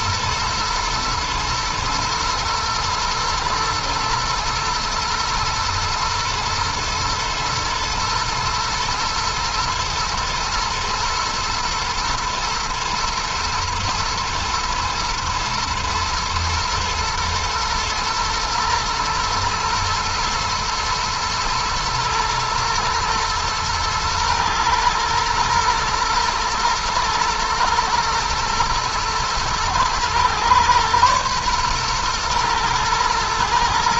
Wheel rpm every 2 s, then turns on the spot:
120, 110, 110, 110, 120, 120, 120, 110, 110, 110, 110, 110, 110, 110, 110, 120, 110.
none